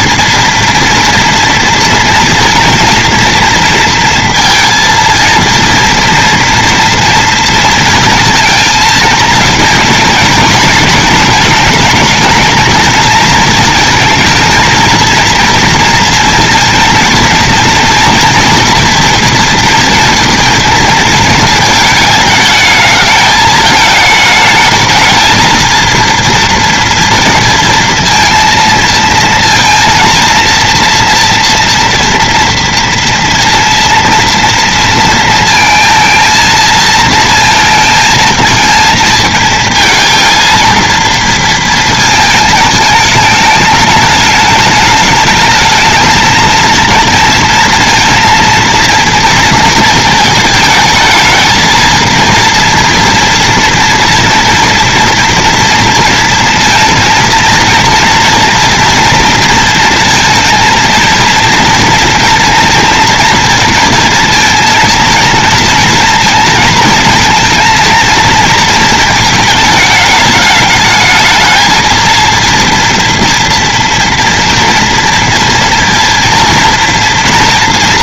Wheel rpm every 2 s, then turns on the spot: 230, 230, 230, 230, 230, 220, 220, 220, 230, 230, 230, 210, 220, 230, 230, 230, 230, 230, 230, 220, 230, 220, 210, 220, 230, 220, 240, 230, 230, 230, 230, 230, 230, 230, 230, 220, 230, 230, 230.
none